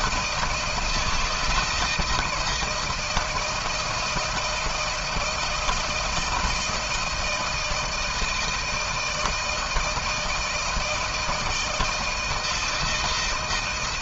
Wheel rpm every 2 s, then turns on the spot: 160, 170, 160, 160, 160, 160, 160.
none